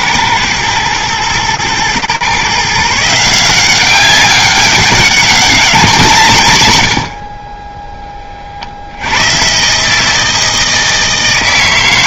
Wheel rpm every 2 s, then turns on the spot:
110, 150, 190, 90, 70, 160.
none